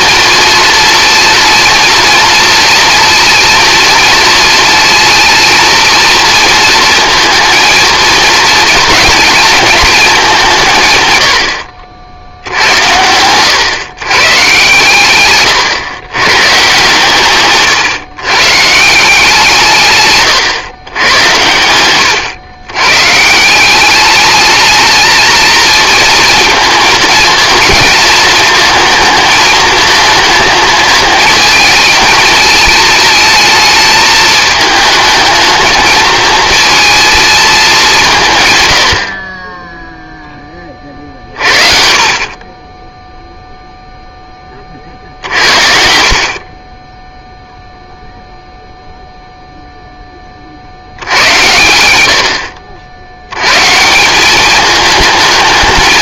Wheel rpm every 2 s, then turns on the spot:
240, 230, 230, 230, 230, 160, 80, 130, 130, 150, 120, 120, 220, 230, 220, 220, 220, 210, 220, 100, 30, 20, 50, 20, 0, 70, 70, 210.
none